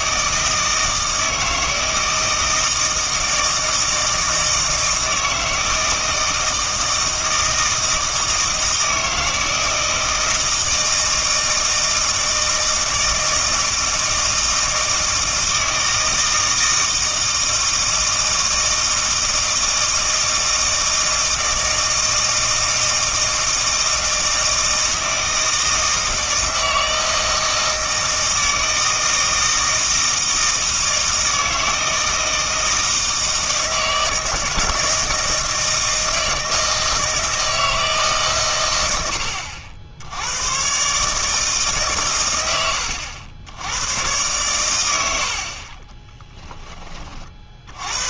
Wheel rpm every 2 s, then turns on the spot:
160, 160, 160, 160, 160, 160, 160, 160, 160, 160, 160, 160, 160, 160, 160, 160, 160, 160, 160, 120, 100, 110, 110, 10.
none